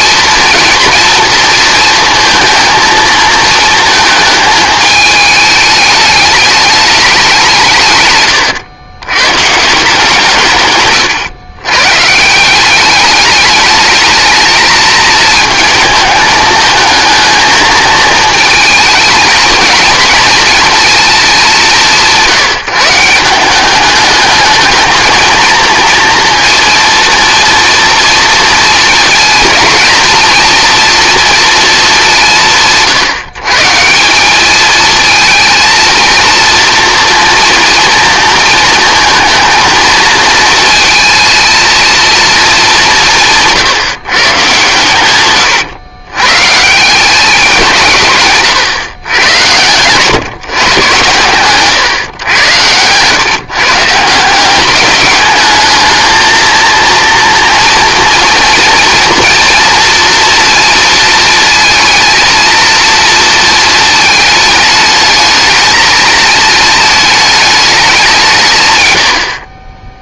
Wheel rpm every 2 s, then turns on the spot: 230, 230, 220, 210, 100, 130, 180, 220, 220, 230, 230, 170, 210, 230, 230, 230, 170, 210, 230, 230, 230, 210, 120, 140, 130, 130, 110, 190, 230, 230, 230, 230, 210, 220, 140.
none